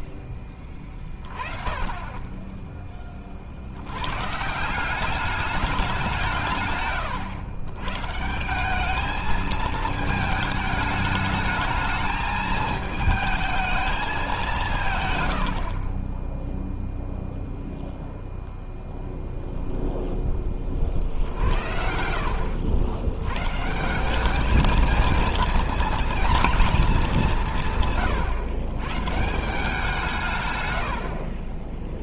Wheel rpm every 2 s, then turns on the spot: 10, 10, 160, 140, 190, 220, 220, 180, 0, 0, 30, 80, 210, 220, 130, 120.
none